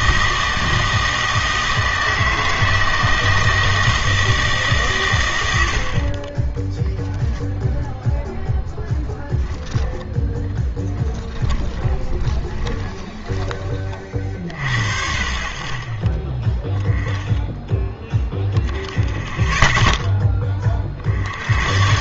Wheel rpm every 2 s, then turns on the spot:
160, 160, 140, 10, 0, 10, 20, 70, 10, 0, 50.
10-14